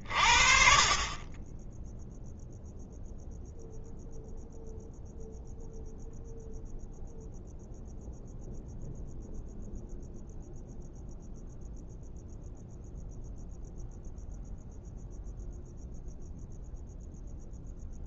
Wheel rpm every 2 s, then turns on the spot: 40, 0, 0, 0, 0, 0, 0, 0, 0.
none